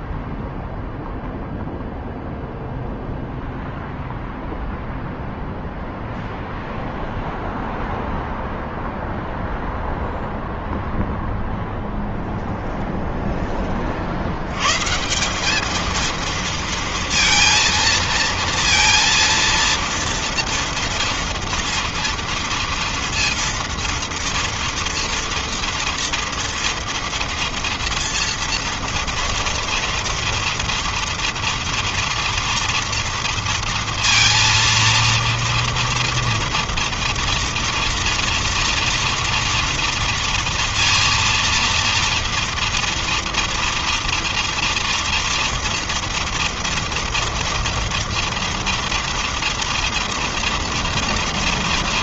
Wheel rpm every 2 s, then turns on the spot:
0, 0, 0, 0, 0, 0, 0, 160, 230, 230, 230, 230, 230, 230, 230, 230, 230, 230, 230, 230, 230, 230, 240, 230, 230, 240.
none